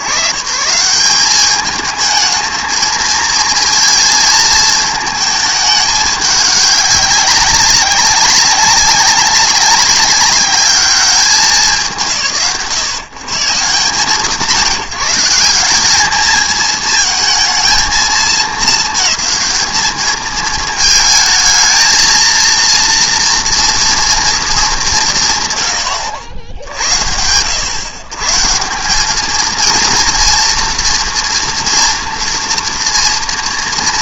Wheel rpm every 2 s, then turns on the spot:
120, 220, 220, 200, 190, 210, 110, 160, 220, 220, 220, 230, 190, 70, 190, 240, 240.
none